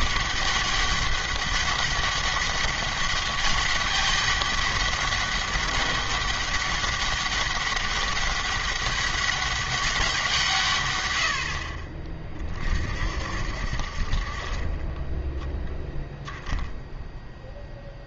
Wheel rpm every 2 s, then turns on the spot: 200, 200, 200, 200, 200, 130, 50, 20, 0.
none